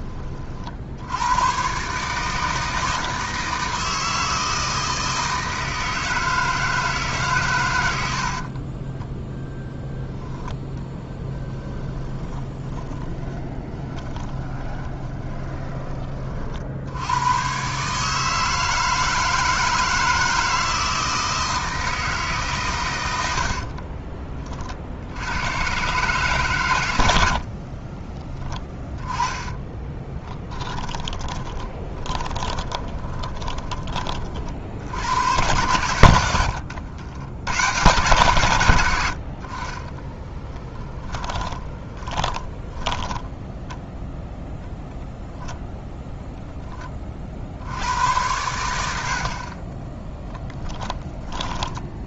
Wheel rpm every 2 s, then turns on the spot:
70, 160, 160, 150, 20, 0, 20, 20, 70, 160, 160, 120, 60, 100, 20, 10, 20, 90, 90, 100, 20, 10, 0, 20, 80, 10.
8-10 12-16 28-34 40-44 50-52